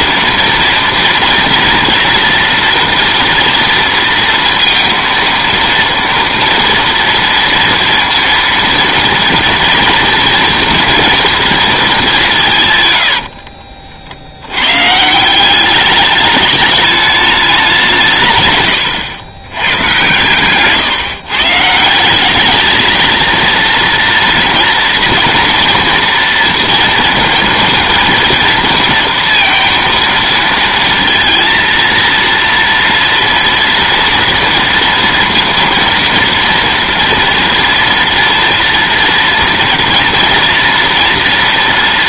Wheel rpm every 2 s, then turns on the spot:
230, 230, 230, 230, 230, 230, 130, 120, 210, 120, 140, 220, 230, 230, 230, 230, 230, 230, 230, 230, 240.
none